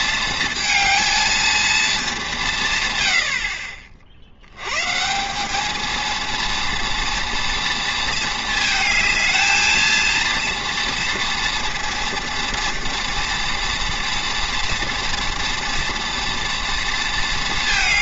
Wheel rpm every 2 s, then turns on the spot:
220, 150, 110, 230, 220, 230, 230, 230, 230.
none